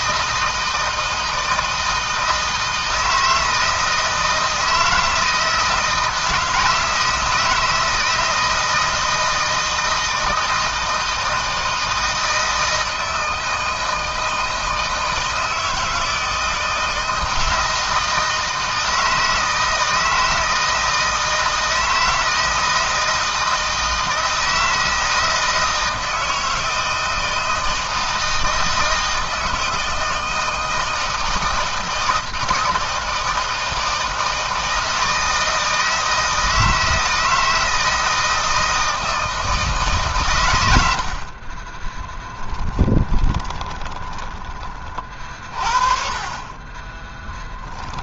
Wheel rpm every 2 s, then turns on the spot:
160, 160, 160, 160, 160, 160, 160, 160, 160, 160, 160, 160, 160, 160, 160, 160, 160, 160, 160, 160, 90, 30, 40, 20.
42-44 46-48